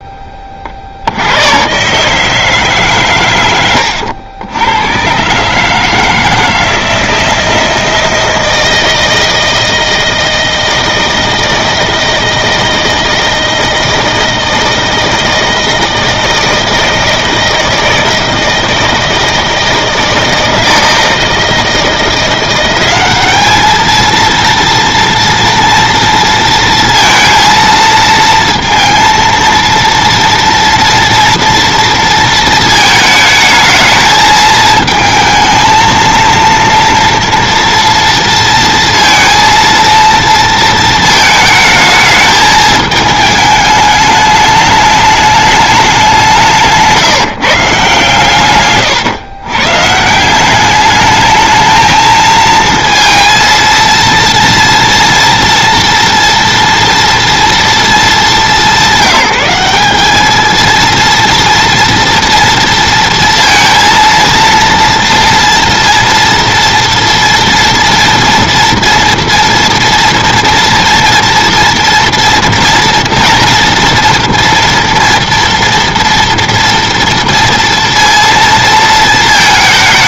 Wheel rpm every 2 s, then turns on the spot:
50, 140, 100, 160, 160, 160, 160, 160, 160, 160, 160, 190, 230, 230, 230, 240, 220, 220, 230, 230, 230, 210, 210, 160, 130, 200, 230, 230, 230, 170, 220, 230, 230, 230, 240, 230, 230, 230, 230, 230.
48-50